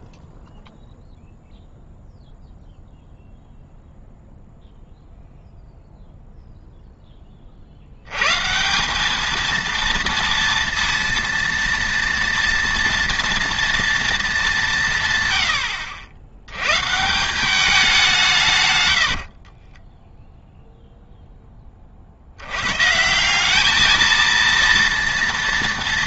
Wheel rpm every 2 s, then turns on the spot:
0, 0, 0, 0, 160, 230, 230, 180, 120, 130, 0, 110, 230.
18-20